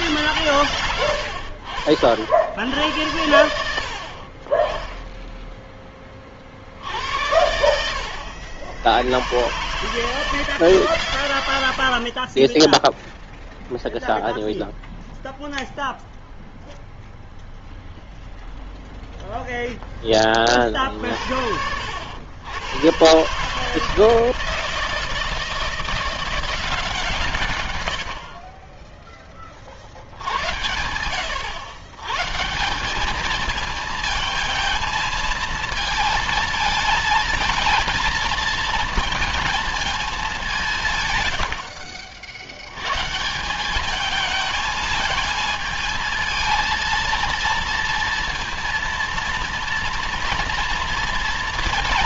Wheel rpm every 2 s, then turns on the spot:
90, 100, 10, 80, 100, 110, 0, 0, 0, 0, 60, 130, 160, 150, 20, 90, 200, 220, 220, 220, 110, 160, 220, 230, 230, 230.
none